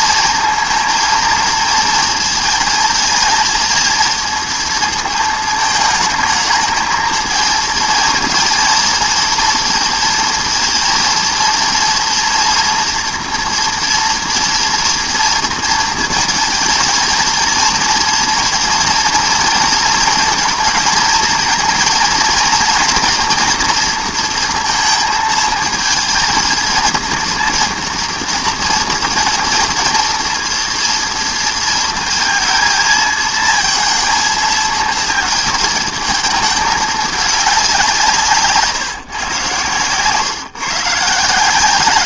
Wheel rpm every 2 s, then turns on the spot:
230, 230, 230, 220, 220, 230, 230, 230, 220, 230, 220, 230, 230, 230, 230, 230, 230, 220, 220, 160, 140.
none